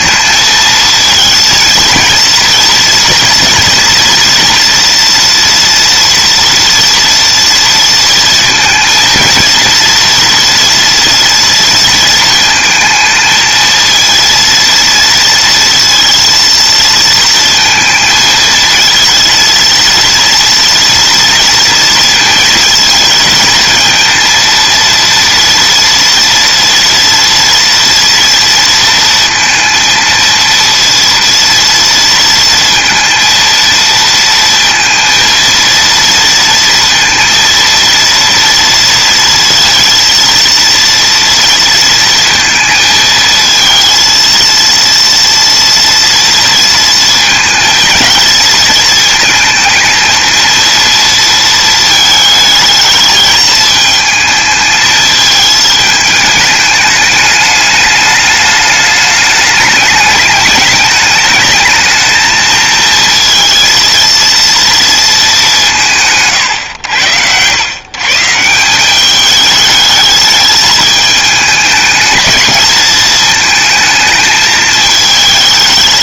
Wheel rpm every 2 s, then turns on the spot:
220, 230, 230, 230, 230, 230, 220, 230, 230, 230, 240, 230, 230, 230, 230, 230, 230, 230, 230, 230, 230, 220, 230, 230, 230, 230, 220, 220, 210, 210, 210, 230, 210, 90, 200, 210, 220, 220.
none